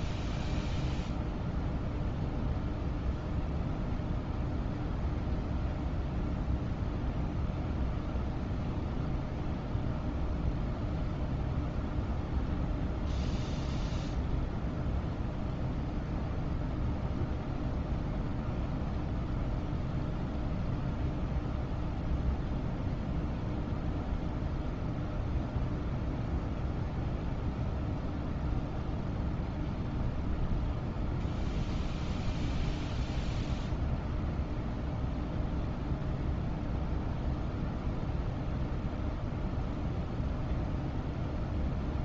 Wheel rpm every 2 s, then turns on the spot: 0, 0, 0, 0, 0, 0, 0, 0, 0, 0, 0, 0, 0, 0, 0, 0, 0, 0, 0, 0, 0.
none